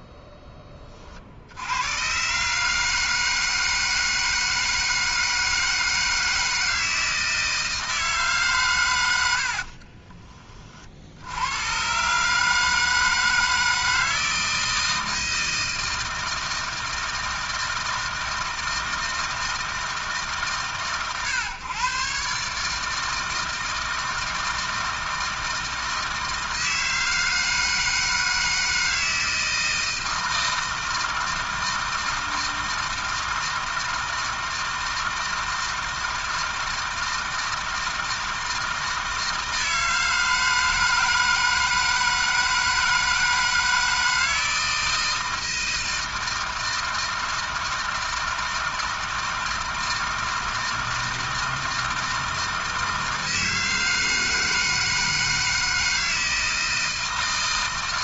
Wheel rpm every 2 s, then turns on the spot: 40, 150, 160, 160, 110, 70, 160, 160, 160, 160, 120, 160, 160, 160, 160, 160, 160, 160, 160, 160, 160, 160, 160, 160, 160, 160, 160, 160, 160.
8-10